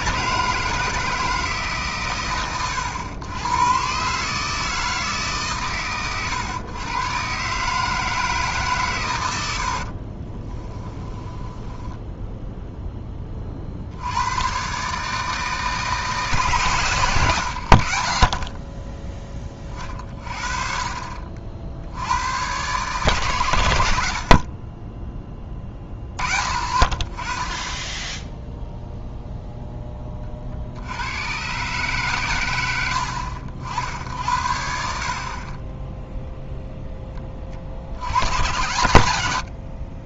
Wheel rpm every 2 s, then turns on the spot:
160, 110, 160, 120, 140, 20, 0, 130, 130, 20, 30, 120, 30, 40, 0, 60, 90, 60, 0, 110.
10-12